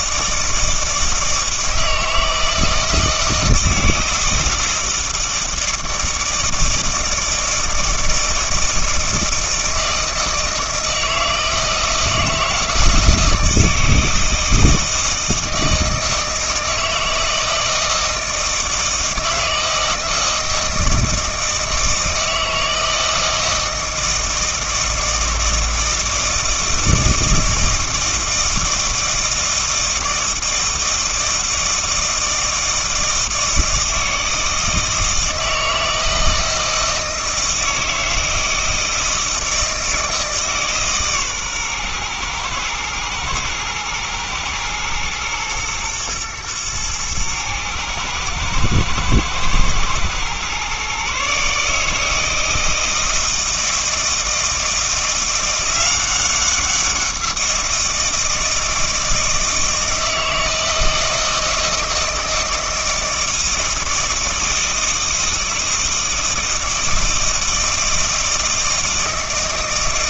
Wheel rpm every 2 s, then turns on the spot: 160, 160, 160, 160, 160, 160, 160, 160, 160, 160, 160, 160, 160, 160, 160, 160, 160, 160, 160, 160, 150, 110, 110, 110, 110, 130, 160, 160, 180, 160, 160, 160, 160, 160, 160.
none